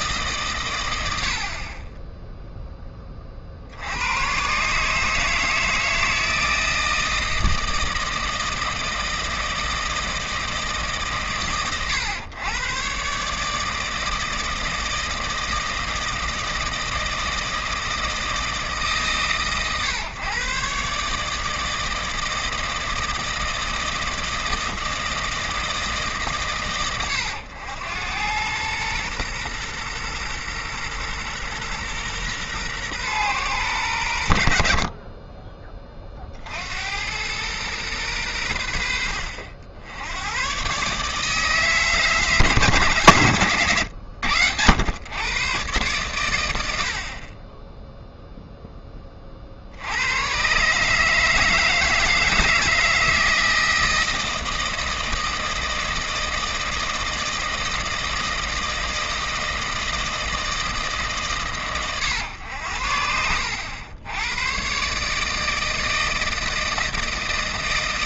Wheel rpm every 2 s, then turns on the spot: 120, 10, 140, 160, 160, 140, 120, 160, 160, 150, 140, 160, 160, 120, 110, 120, 130, 50, 80, 80, 130, 140, 100, 70, 10, 140, 160, 160, 160, 160, 160, 80, 130, 160.
none